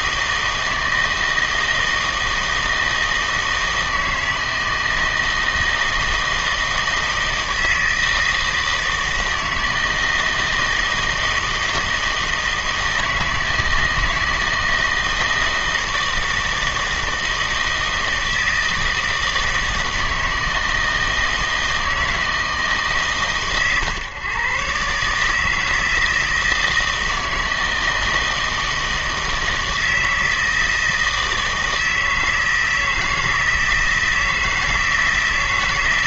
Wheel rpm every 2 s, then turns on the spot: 160, 160, 160, 160, 160, 160, 160, 160, 160, 160, 160, 150, 130, 160, 160, 160, 160, 160.
none